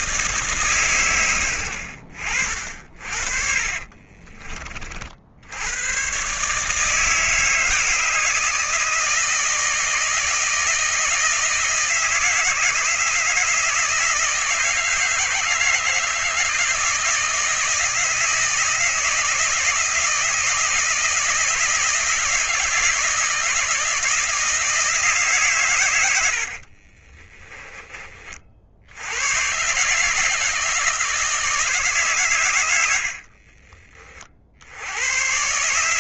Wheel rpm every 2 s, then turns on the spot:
130, 40, 50, 150, 160, 160, 160, 160, 160, 160, 160, 160, 160, 40, 80, 160, 70, 90.
26-28 32-34